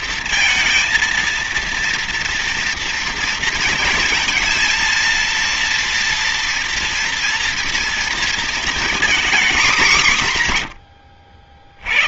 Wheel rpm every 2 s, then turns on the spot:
230, 230, 230, 230, 240, 140.
none